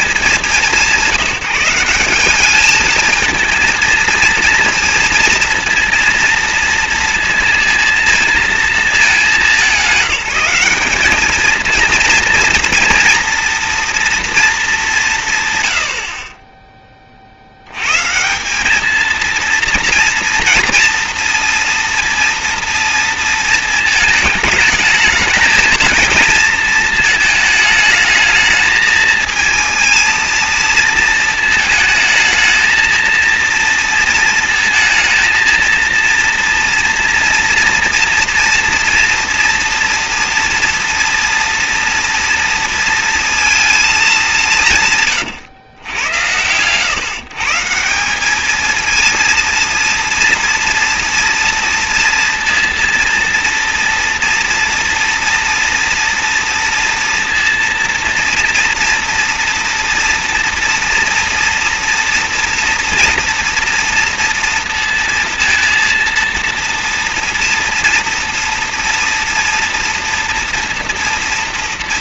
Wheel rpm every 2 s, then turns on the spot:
160, 220, 230, 230, 220, 190, 230, 230, 20, 210, 230, 230, 220, 230, 220, 230, 230, 230, 230, 230, 230, 230, 160, 110, 220, 230, 230, 230, 230, 230, 240, 230, 230, 230, 230, 230.
none